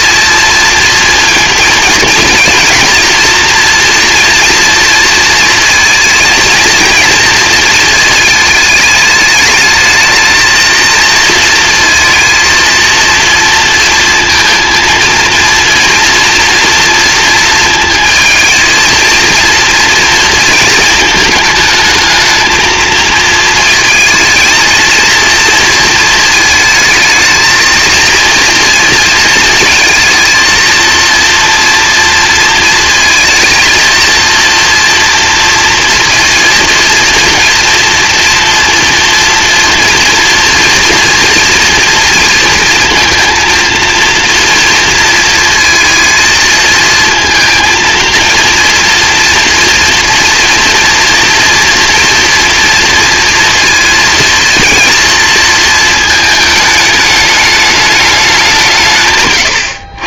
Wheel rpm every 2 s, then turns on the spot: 230, 240, 230, 230, 210, 230, 230, 230, 230, 230, 230, 220, 220, 220, 230, 230, 230, 230, 230, 240, 240, 230, 230, 230, 230, 230, 230, 230, 210, 150.
none